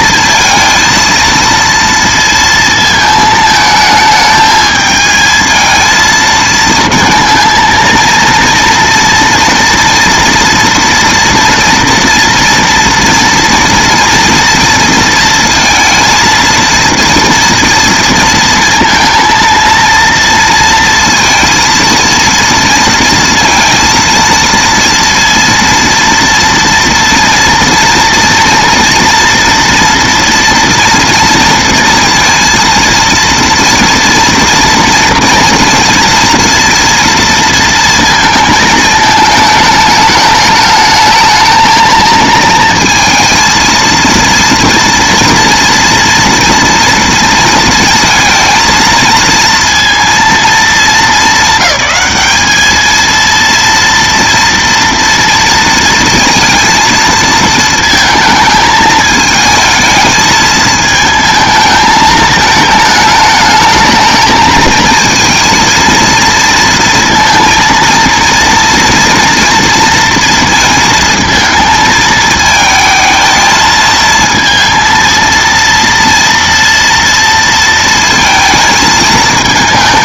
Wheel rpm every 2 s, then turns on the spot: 230, 230, 220, 220, 230, 230, 240, 230, 230, 230, 230, 230, 230, 230, 230, 230, 230, 230, 230, 220, 210, 230, 230, 230, 220, 220, 220, 240, 230, 220, 220, 220, 220, 230, 240, 230, 220, 230, 230, 220.
none